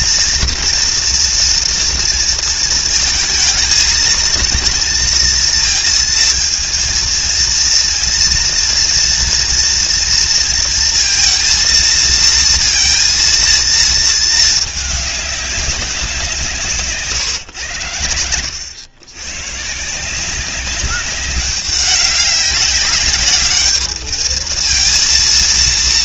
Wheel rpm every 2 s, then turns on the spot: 230, 230, 230, 230, 240, 230, 230, 210, 160, 100, 190, 200, 230.
16-18